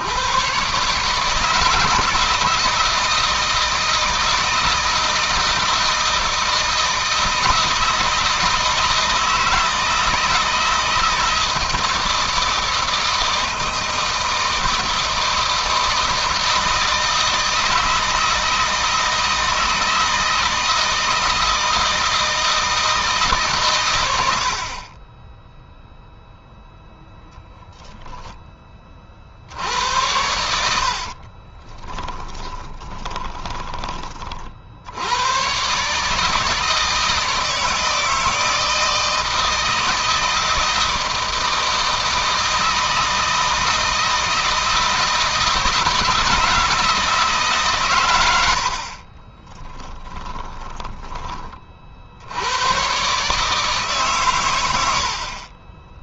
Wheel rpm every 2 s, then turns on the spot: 150, 160, 160, 160, 160, 160, 160, 160, 160, 160, 160, 160, 30, 0, 40, 60, 20, 90, 160, 160, 160, 160, 160, 160, 40, 20, 120, 80.
30-34 48-50